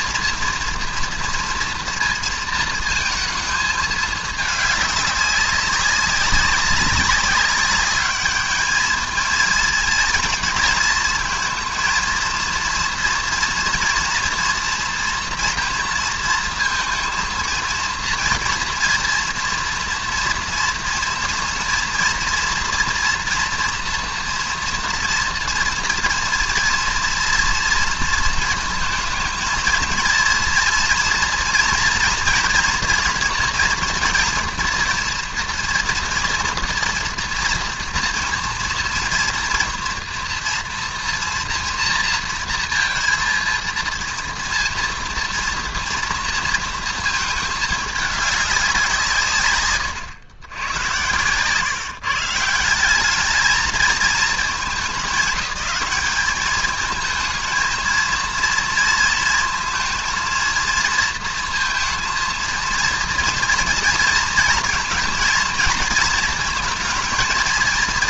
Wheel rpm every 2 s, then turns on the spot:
230, 230, 210, 200, 210, 220, 230, 230, 230, 230, 230, 240, 240, 230, 220, 230, 230, 230, 230, 230, 230, 230, 230, 230, 190, 110, 180, 200, 210, 230, 230, 230, 230, 230.
none